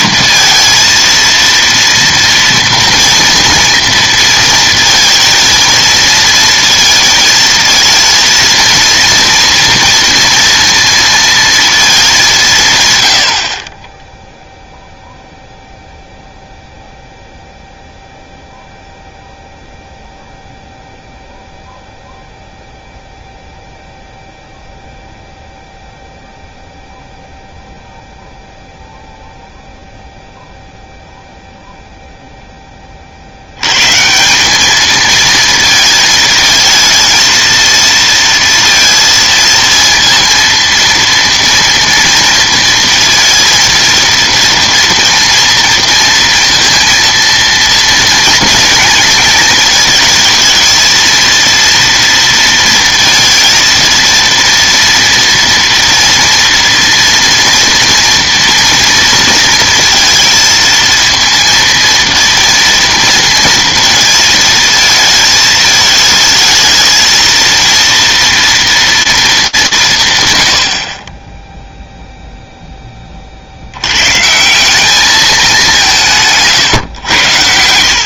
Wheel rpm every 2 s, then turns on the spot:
230, 230, 230, 230, 230, 230, 140, 0, 0, 0, 0, 0, 0, 0, 0, 0, 20, 210, 220, 230, 230, 230, 230, 230, 230, 220, 230, 230, 230, 230, 230, 230, 220, 220, 230, 50, 10, 180, 140.
none